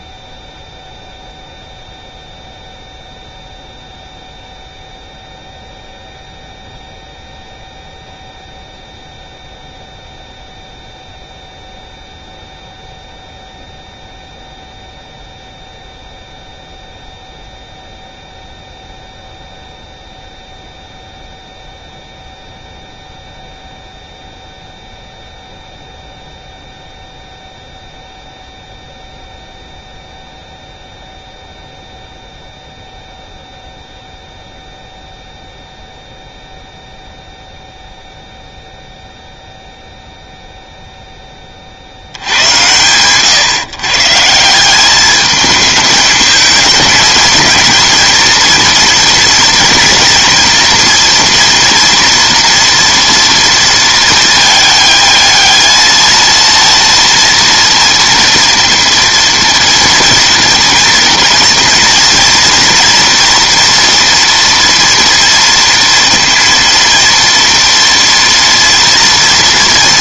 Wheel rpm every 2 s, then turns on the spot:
0, 0, 0, 0, 0, 0, 0, 0, 0, 0, 0, 0, 0, 0, 0, 0, 0, 0, 0, 0, 0, 100, 170, 220, 230, 230, 230, 220, 230, 230, 230, 230, 230, 230, 230.
none